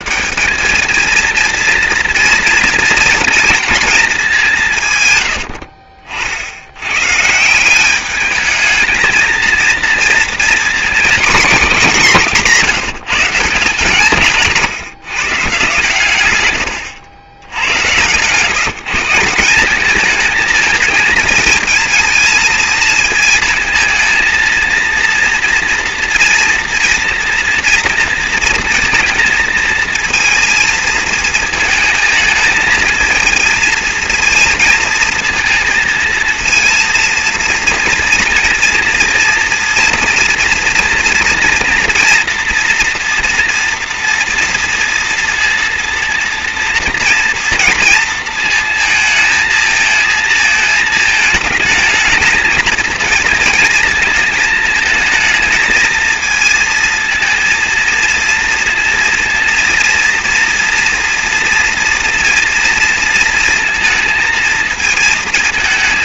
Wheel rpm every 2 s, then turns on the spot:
190, 240, 210, 70, 210, 230, 190, 150, 110, 130, 220, 230, 230, 230, 230, 230, 220, 230, 230, 230, 230, 230, 230, 230, 230, 220, 230, 220, 230, 230, 240, 230, 220.
none